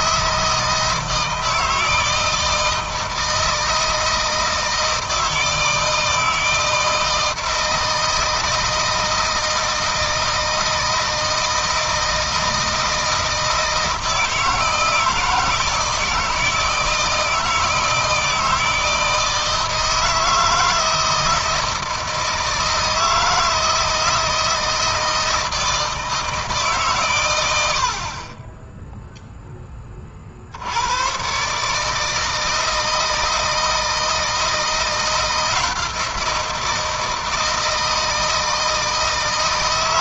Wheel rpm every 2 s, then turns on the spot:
160, 160, 160, 160, 160, 160, 160, 160, 160, 160, 160, 160, 160, 140, 10, 90, 160, 160, 170, 160.
none